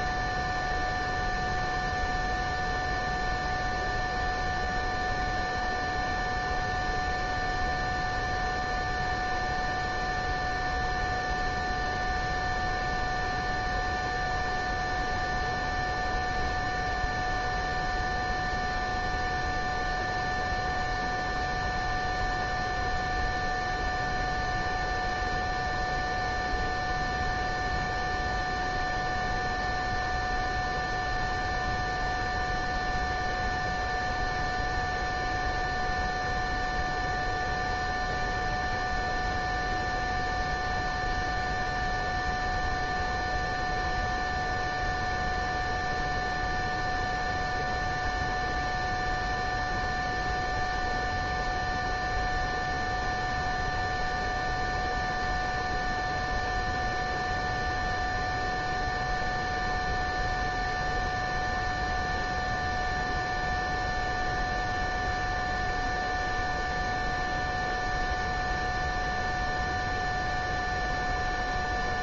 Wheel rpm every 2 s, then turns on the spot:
0, 0, 0, 0, 0, 0, 0, 0, 0, 0, 0, 0, 0, 0, 0, 0, 0, 0, 0, 0, 0, 0, 0, 0, 0, 0, 0, 0, 0, 0, 0, 0, 0, 0, 0, 0.
none